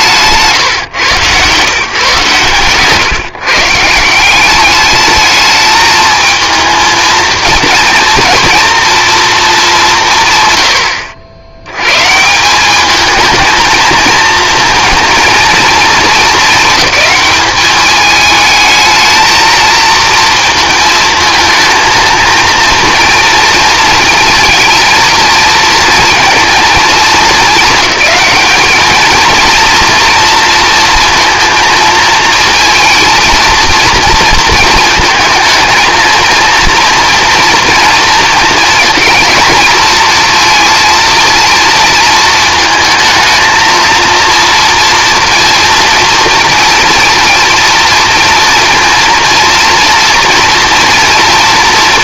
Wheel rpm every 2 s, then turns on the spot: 150, 130, 200, 220, 230, 100, 200, 230, 220, 220, 220, 230, 230, 230, 210, 230, 230, 220, 230, 220, 230, 220, 230, 230, 230, 230.
2-4